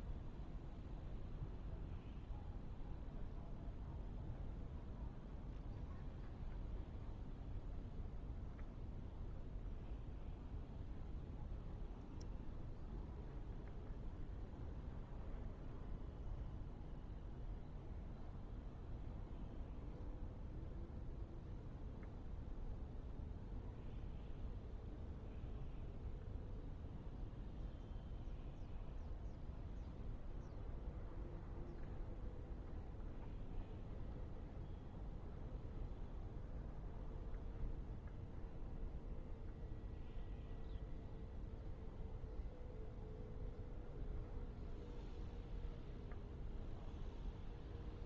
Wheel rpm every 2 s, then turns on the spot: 0, 0, 0, 0, 0, 0, 0, 0, 0, 0, 0, 0, 0, 0, 0, 0, 0, 0, 0, 0, 0, 0, 0, 0.
none